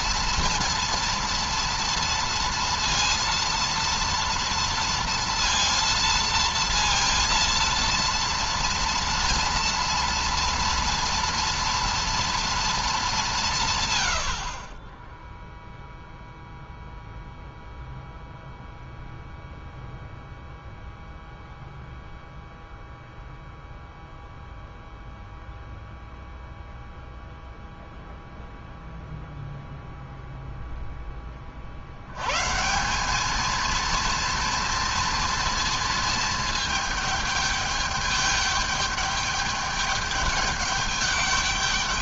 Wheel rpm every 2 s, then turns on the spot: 240, 230, 230, 230, 230, 230, 220, 20, 0, 0, 0, 0, 0, 0, 0, 0, 170, 230, 210, 210, 210.
none